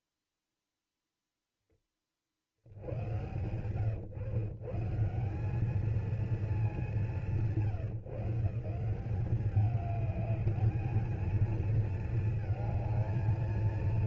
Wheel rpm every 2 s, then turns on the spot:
10, 120, 220, 150, 200, 220, 230.
none